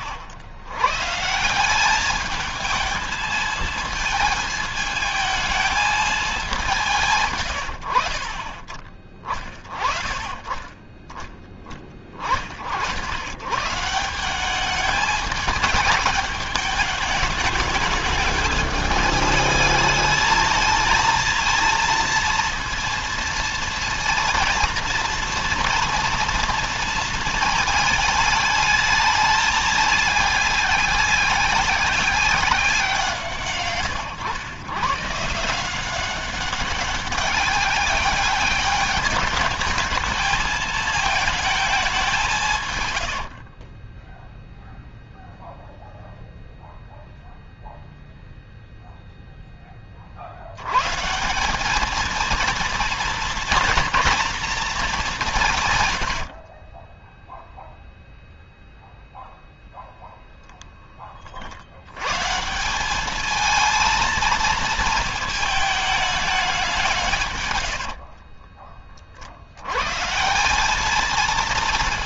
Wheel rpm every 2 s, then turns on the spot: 130, 220, 220, 160, 30, 10, 60, 200, 210, 210, 220, 230, 230, 220, 210, 200, 180, 130, 190, 200, 220, 120, 0, 0, 0, 130, 230, 210, 20, 0, 10, 190, 230, 180, 40, 210.
42-44 56-58